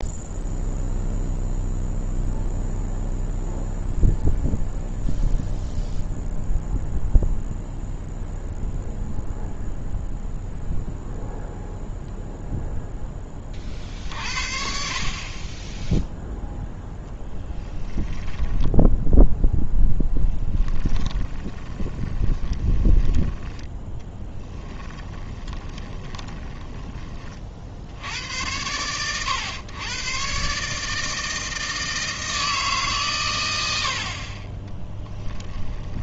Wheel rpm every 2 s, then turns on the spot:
0, 0, 0, 0, 0, 0, 0, 40, 0, 10, 20, 10, 10, 20, 100, 150, 160, 30.
18-28